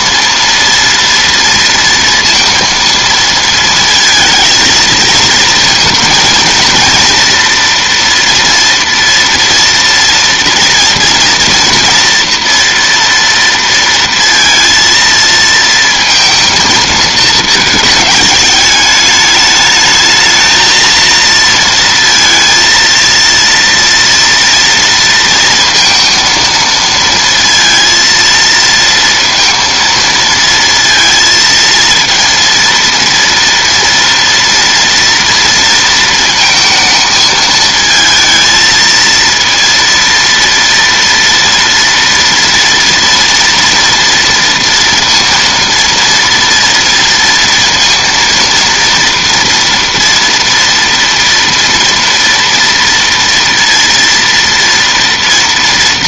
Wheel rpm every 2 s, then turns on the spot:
230, 230, 230, 230, 230, 230, 230, 230, 230, 210, 230, 230, 230, 230, 230, 230, 230, 240, 230, 230, 230, 230, 230, 230, 230, 230, 230, 230.
none